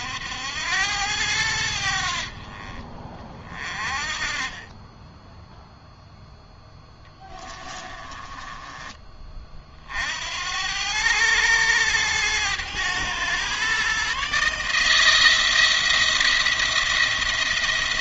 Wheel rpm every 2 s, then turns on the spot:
90, 40, 10, 10, 30, 100, 110, 160, 170.
6-8